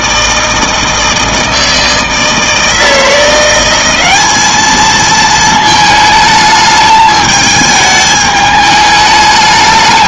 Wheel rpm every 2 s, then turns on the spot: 160, 160, 210, 220, 210.
none